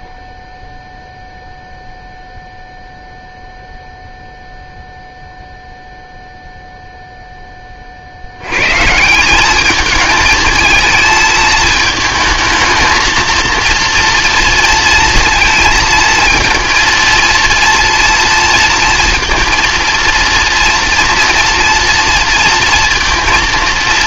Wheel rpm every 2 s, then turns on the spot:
0, 0, 0, 0, 120, 220, 220, 230, 230, 230, 230, 230.
none